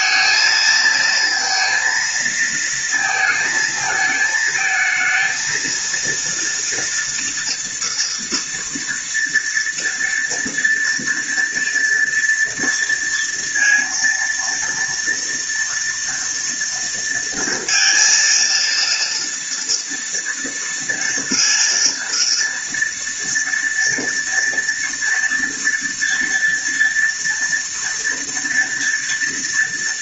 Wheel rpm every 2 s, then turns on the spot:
220, 220, 220, 230, 230, 240, 230, 230, 230, 230, 230, 230, 230, 230, 230.
none